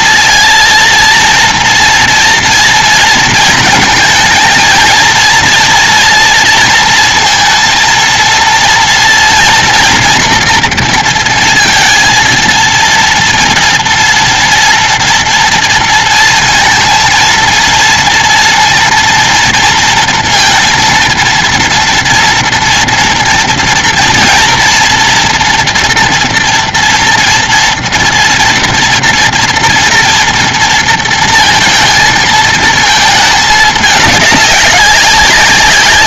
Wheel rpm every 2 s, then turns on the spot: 230, 230, 230, 240, 230, 230, 230, 230, 230, 230, 230, 230, 230, 230, 230, 230, 230, 210.
none